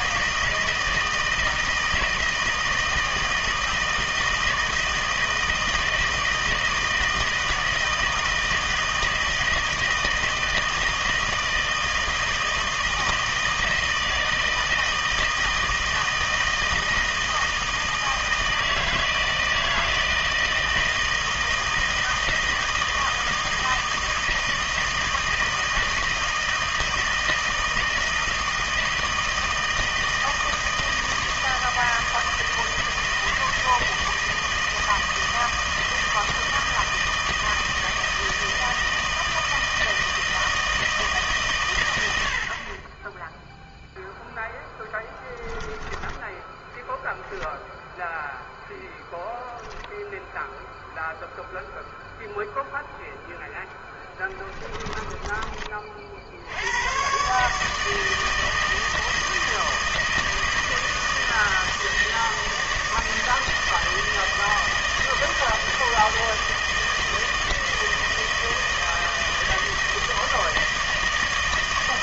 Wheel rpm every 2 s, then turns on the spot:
160, 160, 160, 160, 160, 160, 160, 160, 160, 160, 160, 160, 160, 160, 160, 160, 160, 160, 160, 160, 160, 40, 0, 0, 0, 0, 0, 10, 90, 160, 160, 160, 160, 160, 160, 160.
54-56